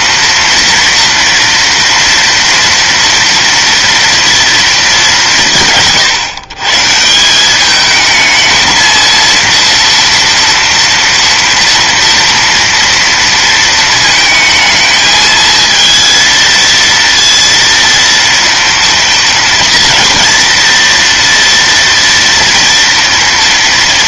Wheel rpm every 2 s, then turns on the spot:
230, 230, 230, 140, 220, 230, 230, 220, 230, 230, 230, 230.
none